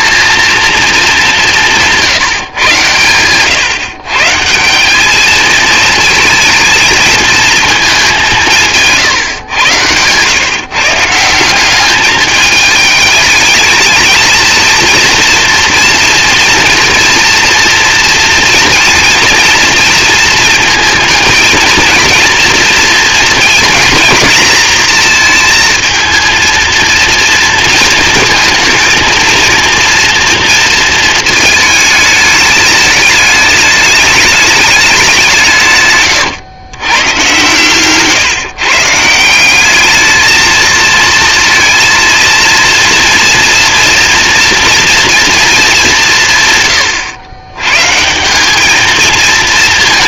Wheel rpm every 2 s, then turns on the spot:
210, 120, 200, 230, 150, 160, 220, 230, 230, 230, 220, 230, 230, 230, 230, 230, 210, 200, 110, 160, 230, 230, 230, 110, 210.
none